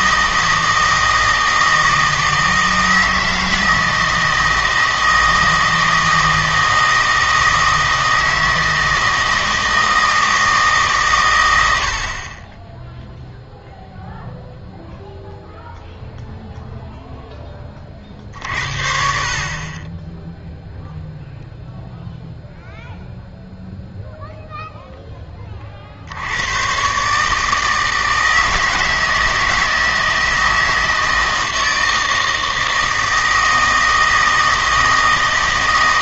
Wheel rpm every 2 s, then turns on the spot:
160, 160, 160, 160, 160, 150, 10, 0, 0, 60, 0, 0, 0, 120, 160, 160, 160, 160.
none